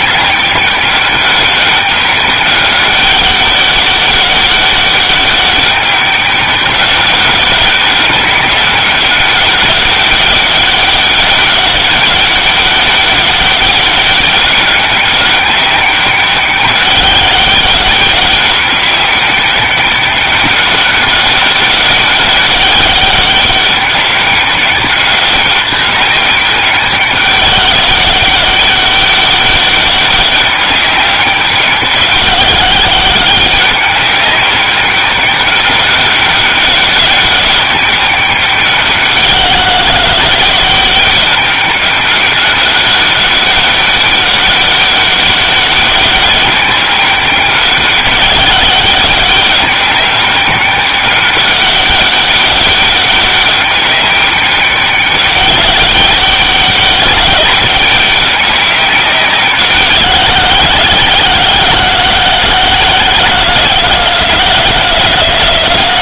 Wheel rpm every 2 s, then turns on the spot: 200, 200, 200, 200, 200, 200, 200, 200, 200, 200, 200, 200, 200, 200, 200, 200, 190, 200, 200, 190, 190, 200, 200, 200, 200, 200, 200, 200, 200, 200, 180, 180, 170.
none